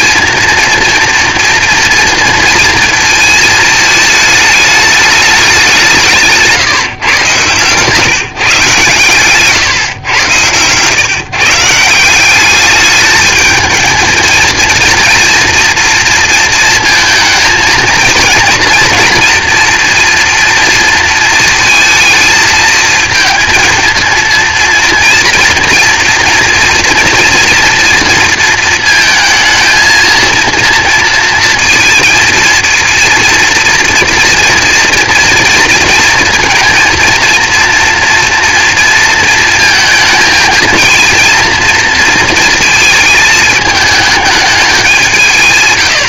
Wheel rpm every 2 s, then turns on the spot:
230, 230, 210, 150, 150, 120, 210, 230, 230, 240, 230, 230, 240, 230, 230, 230, 230, 230, 230, 230, 220, 220, 200.
none